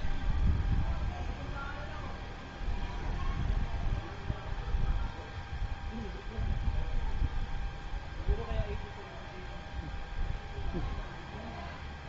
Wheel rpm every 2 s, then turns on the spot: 0, 0, 0, 0, 0, 0.
none